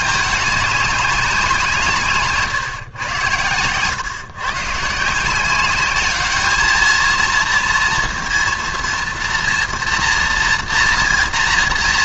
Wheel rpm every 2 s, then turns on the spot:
210, 130, 130, 220, 230, 240.
none